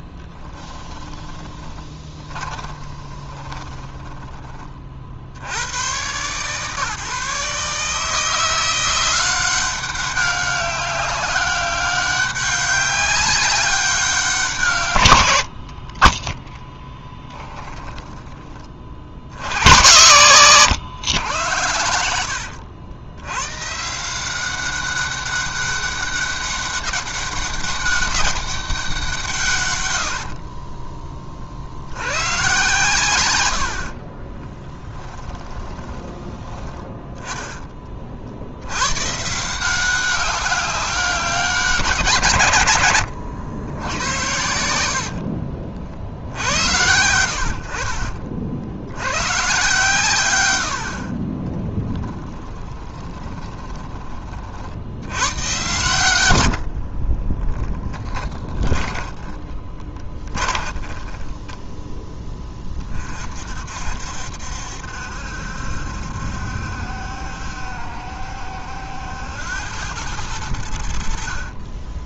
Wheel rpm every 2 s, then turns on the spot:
10, 10, 30, 150, 170, 190, 200, 150, 10, 50, 130, 80, 190, 200, 190, 30, 130, 20, 20, 90, 190, 120, 80, 70, 70, 90, 20, 50, 60, 20, 20, 20, 70, 70, 70, 90.
2-4 16-20 30-32 34-38 52-54 56-62